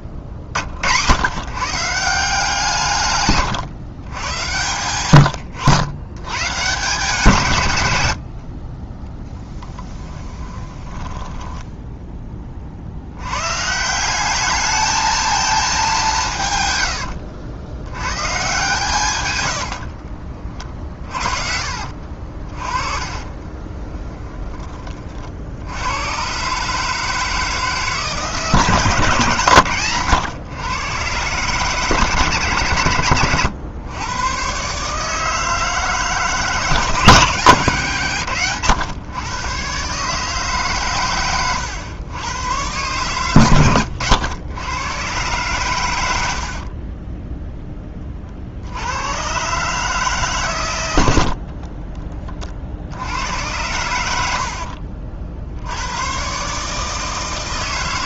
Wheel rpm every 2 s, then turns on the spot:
90, 150, 110, 160, 30, 20, 60, 220, 100, 140, 30, 30, 30, 150, 150, 120, 120, 140, 150, 120, 130, 120, 110, 30, 90, 100, 70, 60, 150.
8-12 16-18 22-24 46-48 54-56